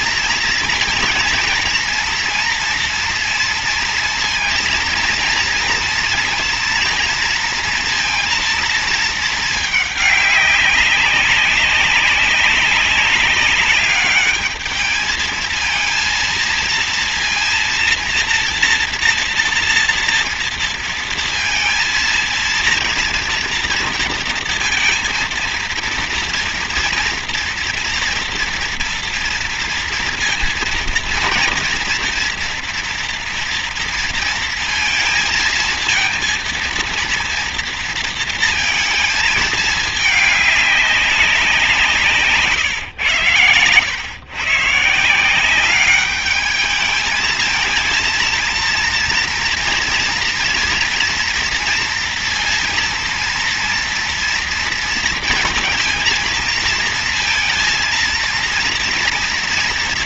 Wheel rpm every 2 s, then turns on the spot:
230, 230, 230, 230, 220, 200, 200, 220, 230, 230, 230, 230, 230, 230, 240, 230, 230, 230, 230, 220, 200, 120, 170, 220, 230, 230, 230, 230, 230, 240.
none